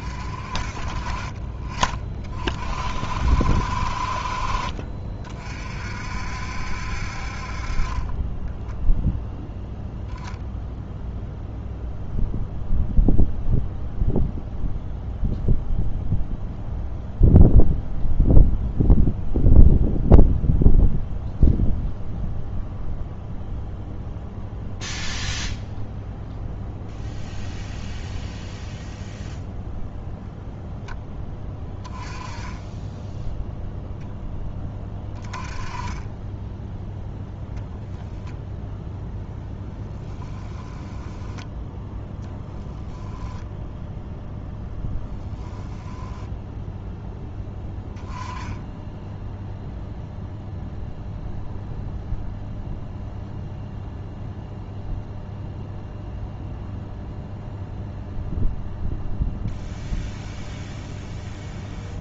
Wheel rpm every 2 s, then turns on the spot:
40, 40, 40, 60, 10, 0, 0, 0, 0, 0, 0, 0, 0, 0, 0, 10, 10, 10, 10, 10, 10, 10, 10, 0, 10, 0, 0, 0, 0, 0, 0.
8-10 40-42 44-46